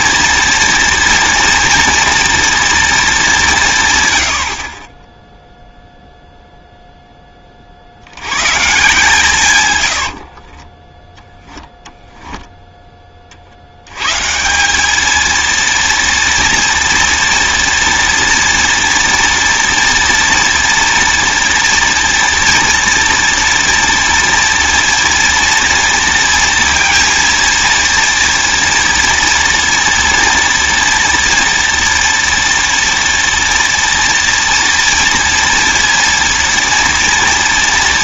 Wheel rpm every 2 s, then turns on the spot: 230, 240, 50, 0, 130, 30, 10, 180, 230, 230, 240, 230, 230, 230, 230, 230, 230, 230, 230.
10-12